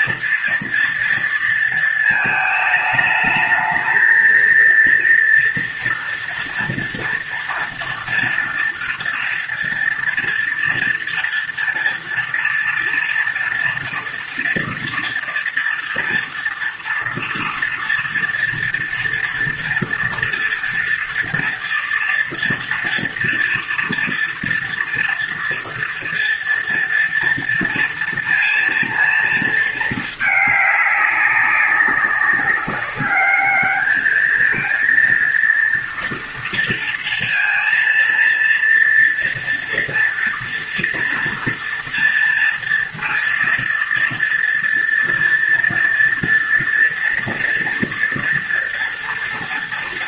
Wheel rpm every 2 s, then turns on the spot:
240, 220, 230, 230, 230, 230, 230, 230, 230, 240, 240, 240, 230, 230, 230, 210, 200, 220, 230, 230, 230, 230, 230, 230, 230.
none